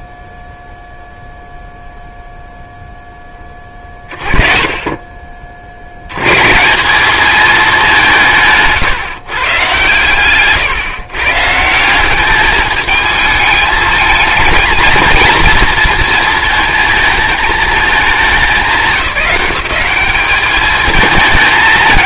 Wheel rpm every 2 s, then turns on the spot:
0, 0, 30, 150, 150, 130, 210, 220, 220, 180, 210.
8-10